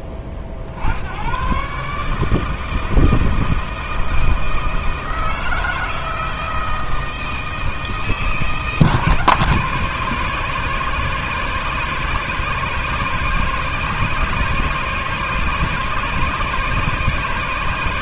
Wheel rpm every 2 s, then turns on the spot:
80, 160, 160, 160, 160, 140, 150, 150, 150.
none